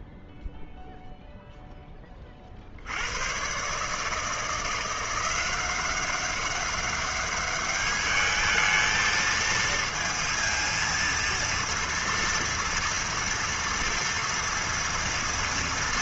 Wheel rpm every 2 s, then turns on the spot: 0, 100, 180, 200, 220, 230, 230, 230.
none